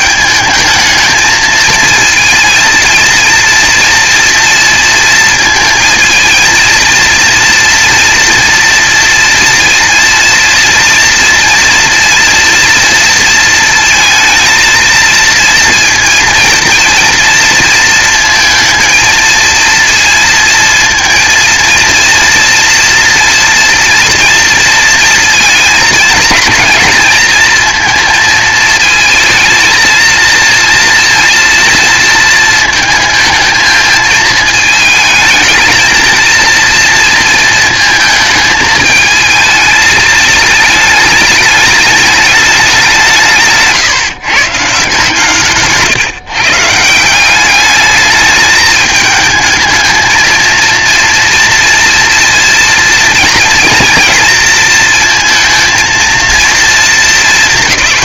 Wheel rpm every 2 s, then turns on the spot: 220, 230, 230, 230, 230, 230, 230, 230, 230, 220, 230, 230, 230, 220, 220, 230, 220, 220, 230, 220, 210, 200, 150, 160, 220, 230, 230, 230, 230.
none